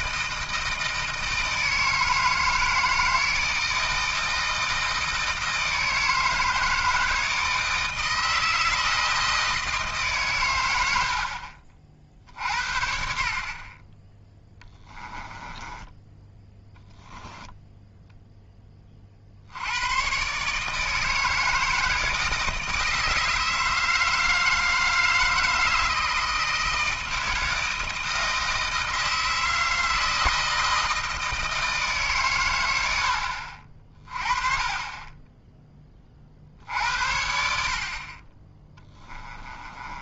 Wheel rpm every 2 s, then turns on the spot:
160, 160, 160, 160, 160, 100, 70, 10, 10, 20, 150, 160, 160, 160, 160, 160, 100, 20, 60, 20.
14-16 38-40